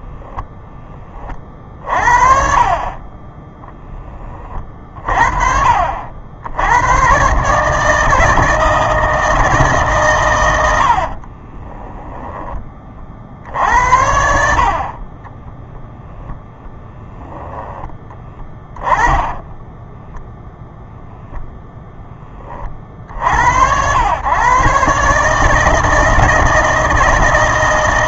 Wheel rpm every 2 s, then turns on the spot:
20, 20, 50, 110, 160, 70, 30, 30, 10, 20, 0, 40, 140, 160.
10-12 18-20